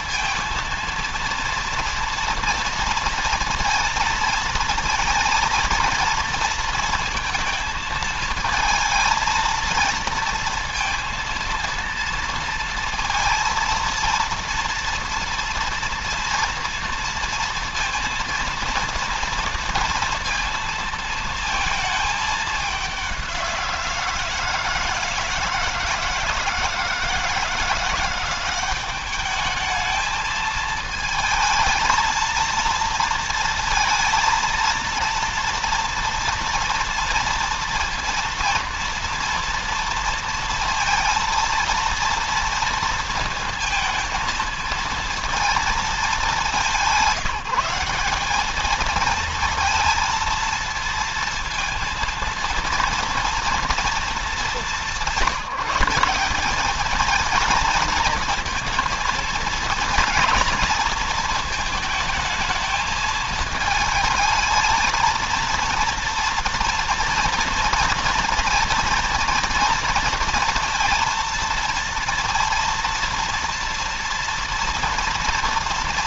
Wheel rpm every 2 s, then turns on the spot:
230, 230, 230, 230, 220, 230, 230, 230, 230, 230, 230, 190, 160, 160, 200, 220, 230, 230, 230, 230, 230, 230, 230, 190, 230, 230, 230, 190, 220, 230, 220, 220, 230, 230, 230, 230, 230, 230.
none